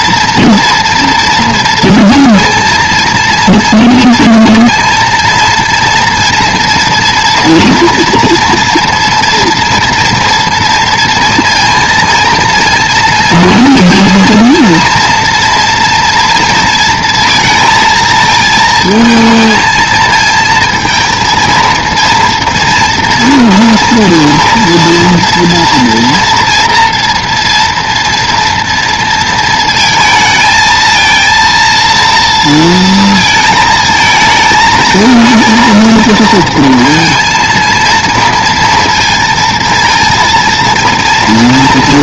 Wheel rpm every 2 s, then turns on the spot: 230, 230, 230, 230, 230, 230, 230, 230, 230, 220, 230, 230, 230, 230, 230, 220, 230, 220, 230, 230, 230.
none